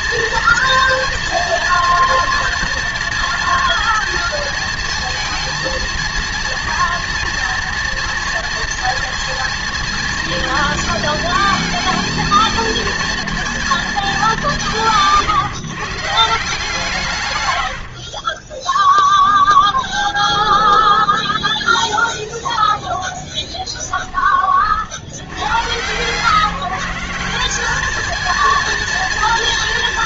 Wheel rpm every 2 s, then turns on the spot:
230, 230, 220, 230, 230, 230, 220, 190, 160, 20, 20, 0, 30, 160, 230.
20-22